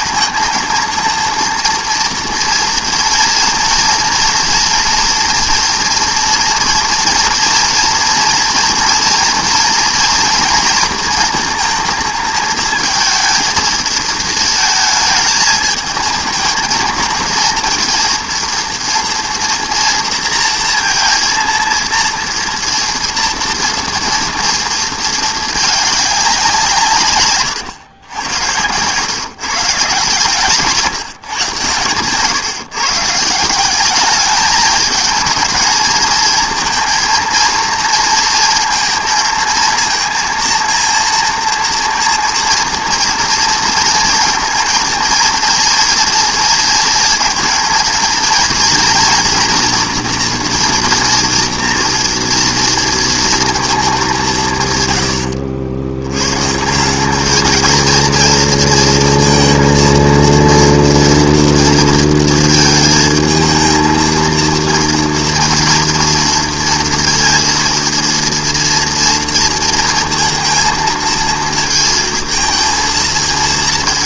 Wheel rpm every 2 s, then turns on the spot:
230, 230, 230, 230, 230, 230, 220, 220, 220, 230, 230, 230, 230, 190, 100, 140, 130, 210, 230, 230, 230, 230, 230, 230, 230, 240, 230, 180, 110, 230, 230, 230, 230, 230, 230, 230, 220.
none